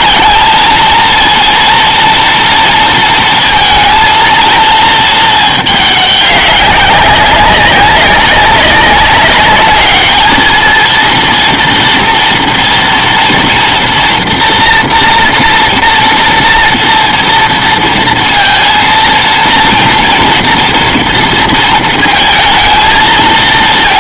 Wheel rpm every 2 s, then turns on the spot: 220, 230, 230, 200, 190, 220, 230, 230, 230, 230, 230, 220.
none